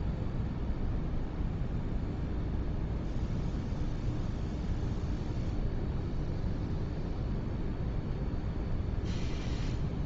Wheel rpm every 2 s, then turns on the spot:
0, 0, 0, 0, 0.
none